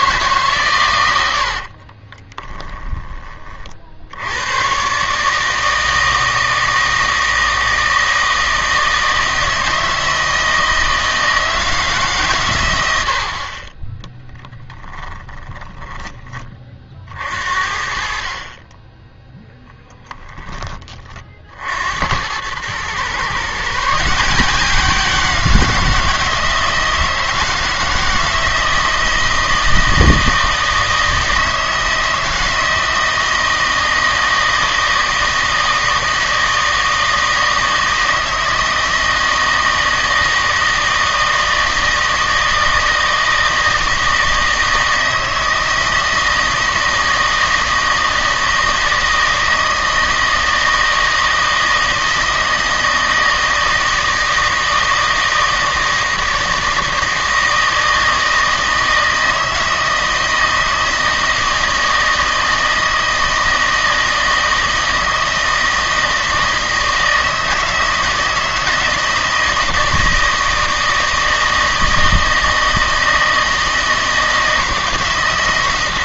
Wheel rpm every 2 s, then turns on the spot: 130, 20, 120, 160, 160, 160, 100, 20, 40, 20, 20, 110, 180, 170, 160, 160, 160, 160, 160, 160, 160, 160, 160, 160, 160, 160, 160, 160, 160, 160, 160, 160, 160, 160, 160, 160, 160, 160.
2-4 14-16